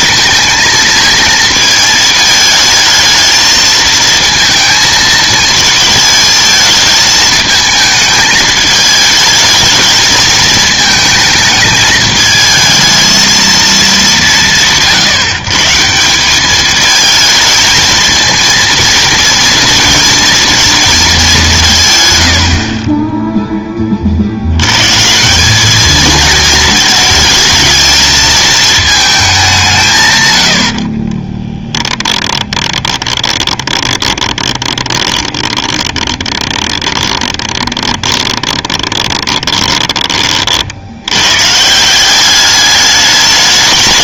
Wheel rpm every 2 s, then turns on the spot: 230, 220, 230, 220, 220, 220, 220, 180, 210, 230, 230, 60, 80, 220, 220, 90, 20, 20, 20, 20, 70, 210.
32-40